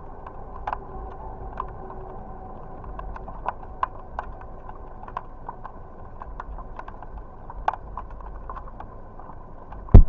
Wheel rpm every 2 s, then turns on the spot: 0, 0, 0, 0, 0.
none